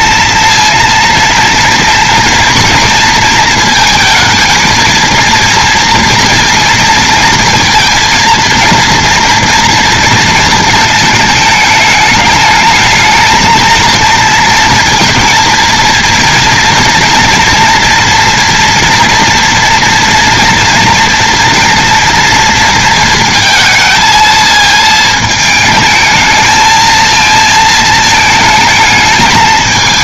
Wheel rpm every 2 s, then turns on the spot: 230, 230, 220, 230, 230, 230, 210, 230, 230, 230, 230, 230, 220, 220, 220.
none